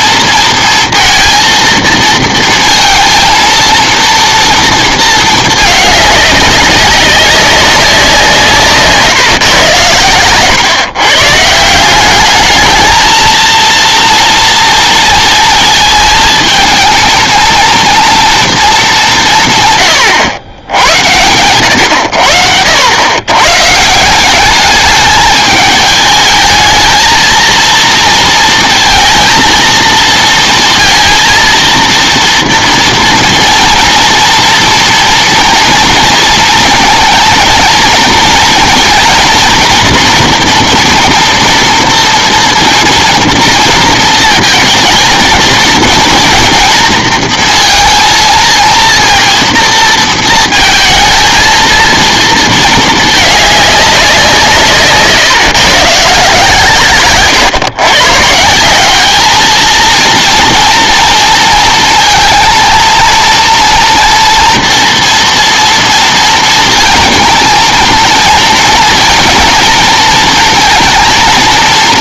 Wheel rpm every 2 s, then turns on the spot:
230, 230, 230, 190, 150, 140, 220, 230, 220, 210, 90, 90, 210, 220, 230, 230, 230, 230, 230, 230, 240, 240, 220, 230, 230, 220, 220, 150, 130, 200, 230, 230, 230, 230, 230, 230.
none